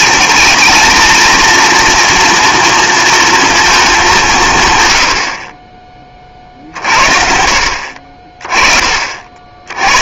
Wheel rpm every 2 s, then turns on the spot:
230, 230, 160, 40, 30.
none